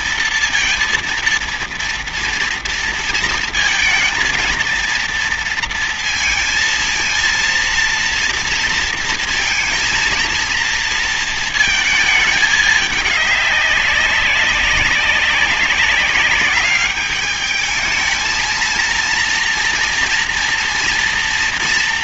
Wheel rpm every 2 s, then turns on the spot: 230, 230, 230, 230, 230, 230, 210, 190, 200, 230, 230.
none